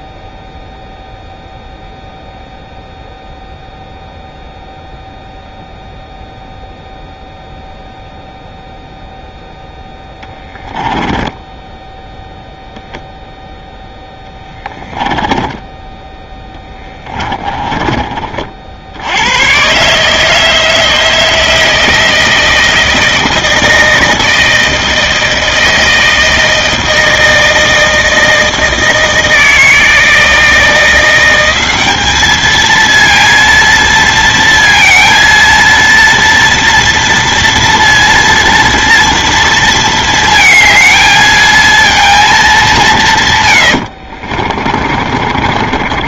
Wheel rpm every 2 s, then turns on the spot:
0, 0, 0, 0, 0, 0, 0, 10, 10, 60, 160, 160, 160, 160, 160, 170, 220, 230, 230, 230, 220, 200, 40.
14-18 44-46